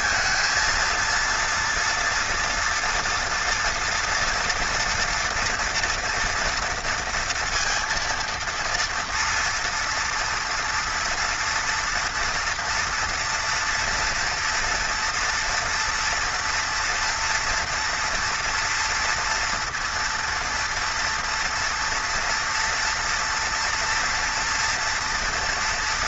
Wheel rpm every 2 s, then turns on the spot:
230, 230, 230, 230, 230, 230, 240, 230, 230, 230, 230, 230, 230.
none